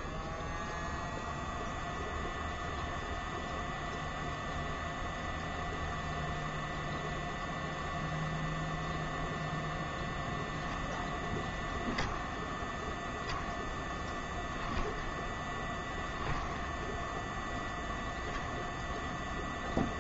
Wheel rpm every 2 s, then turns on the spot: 0, 0, 0, 0, 0, 0, 0, 0, 0, 0.
none